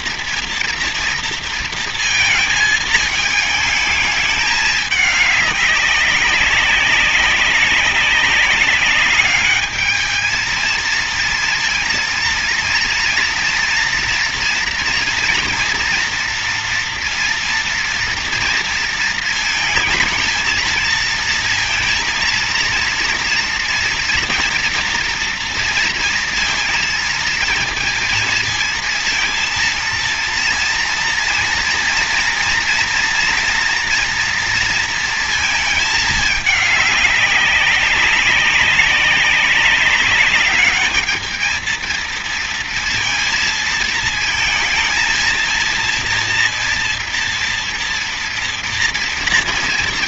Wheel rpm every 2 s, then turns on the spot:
240, 220, 210, 200, 200, 220, 230, 230, 230, 230, 220, 230, 240, 230, 230, 230, 230, 230, 210, 200, 200, 230, 220, 230, 230.
none